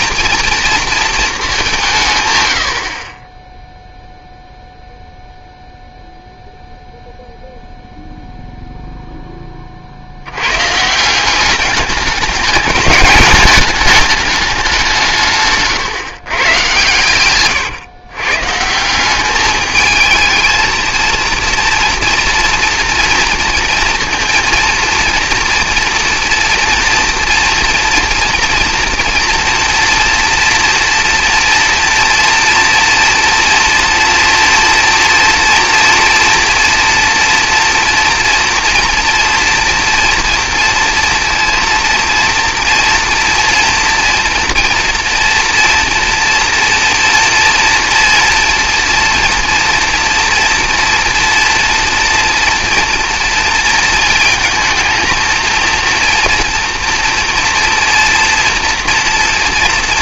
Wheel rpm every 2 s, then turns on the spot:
230, 100, 0, 0, 0, 130, 210, 190, 130, 160, 220, 230, 230, 230, 230, 230, 230, 230, 230, 230, 230, 230, 230, 230, 230, 240, 230, 230, 230, 230.
none